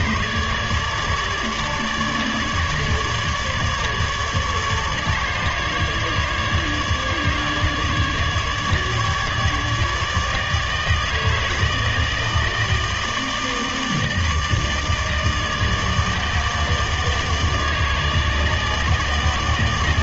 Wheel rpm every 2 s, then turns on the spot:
150, 150, 150, 150, 150, 150, 160, 150, 150, 150.
none